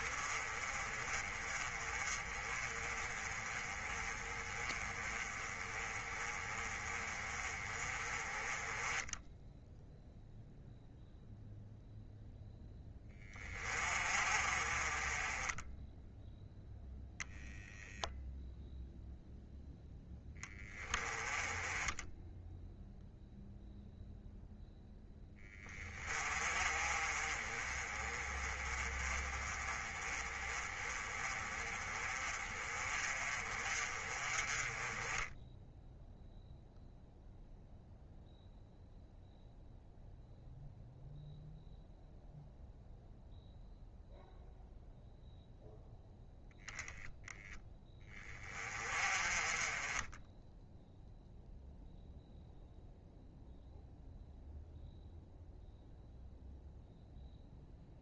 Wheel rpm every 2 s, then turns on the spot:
30, 30, 20, 30, 10, 0, 20, 30, 0, 0, 20, 0, 0, 30, 30, 30, 30, 20, 0, 0, 0, 0, 0, 0, 30, 0, 0, 0, 0.
none